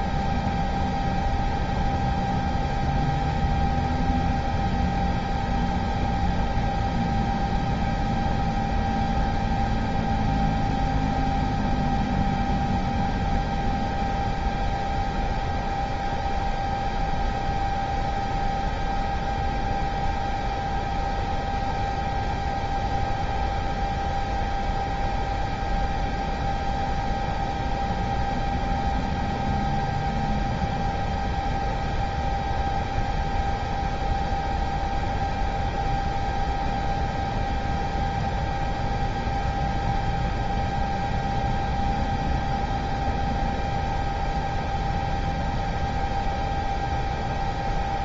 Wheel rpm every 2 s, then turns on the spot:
0, 0, 0, 0, 0, 0, 0, 0, 0, 0, 0, 0, 0, 0, 0, 0, 0, 0, 0, 0, 0, 0, 0, 0.
none